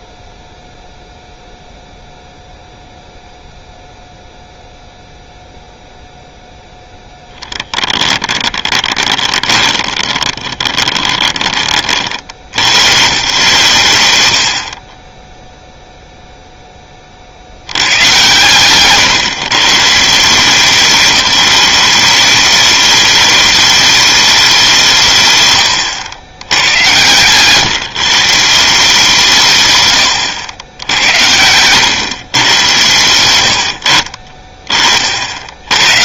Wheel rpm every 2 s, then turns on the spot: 0, 0, 0, 0, 20, 20, 100, 20, 10, 130, 190, 210, 180, 100, 170, 90, 120, 40.
8-12 26-28 30-32